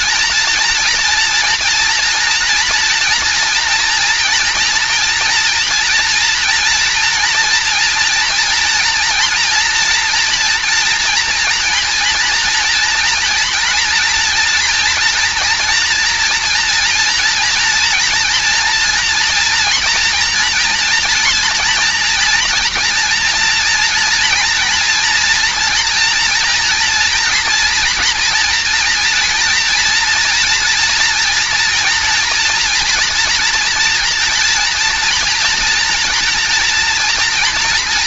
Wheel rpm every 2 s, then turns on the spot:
230, 240, 230, 240, 230, 230, 240, 230, 230, 230, 230, 230, 230, 230, 240, 230, 240, 240, 230.
none